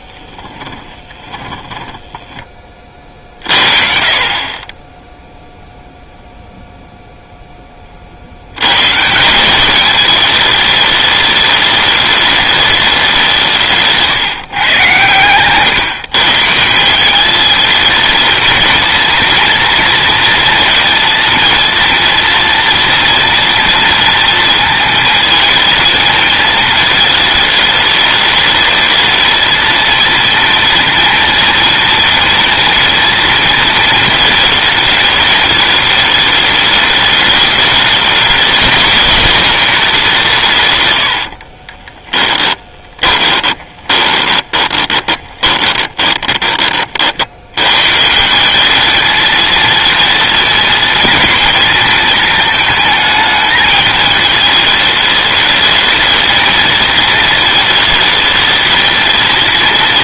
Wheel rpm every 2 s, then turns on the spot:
10, 40, 10, 0, 140, 210, 200, 130, 170, 230, 230, 230, 230, 220, 220, 230, 230, 220, 210, 220, 110, 10, 20, 40, 210, 230, 220, 210, 220, 220.
0-2 14-16 42-46